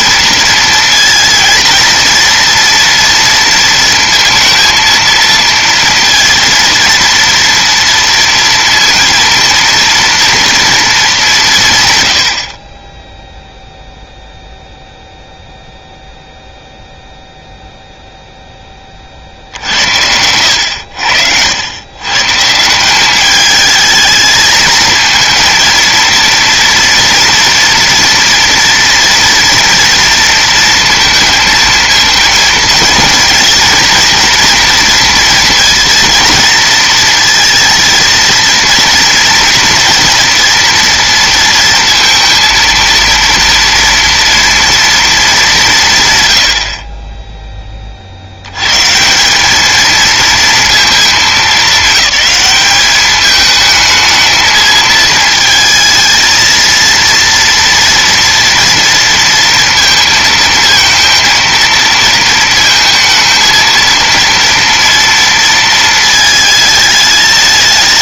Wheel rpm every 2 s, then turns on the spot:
230, 230, 230, 230, 230, 230, 40, 0, 0, 10, 90, 160, 220, 230, 230, 230, 230, 230, 220, 230, 230, 230, 230, 70, 110, 220, 200, 220, 230, 230, 220, 230, 230, 220.
none